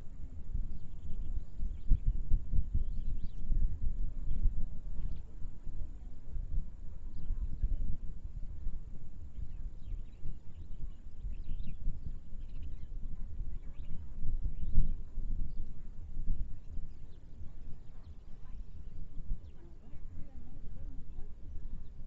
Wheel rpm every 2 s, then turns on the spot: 0, 0, 0, 0, 0, 0, 0, 0, 0, 0, 0.
none